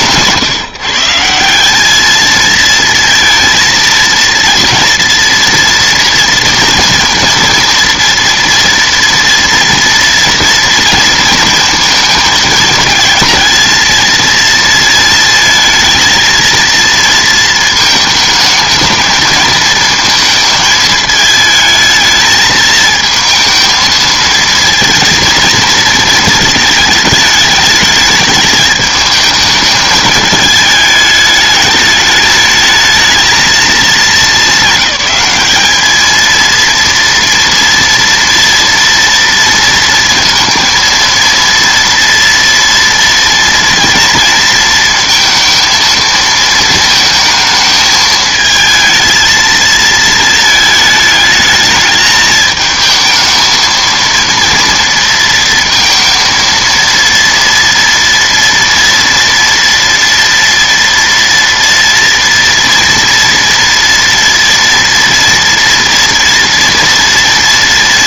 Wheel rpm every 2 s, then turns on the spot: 160, 220, 230, 230, 230, 230, 220, 230, 230, 220, 220, 220, 230, 220, 210, 210, 220, 220, 230, 230, 230, 230, 230, 230, 220, 220, 220, 230, 230, 230, 230, 230, 230, 230.
none